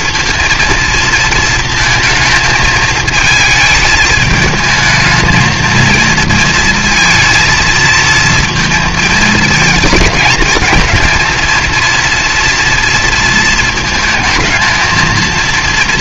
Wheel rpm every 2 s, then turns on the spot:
230, 220, 220, 230, 230, 220, 230, 220.
none